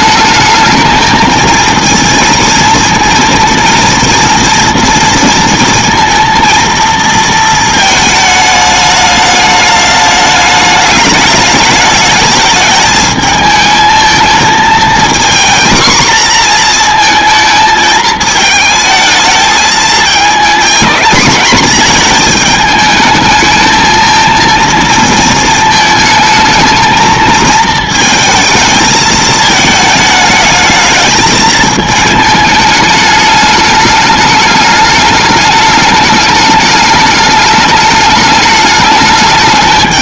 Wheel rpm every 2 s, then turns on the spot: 220, 230, 230, 230, 210, 210, 220, 220, 230, 220, 240, 220, 230, 220, 220, 220, 210, 210, 210, 210.
none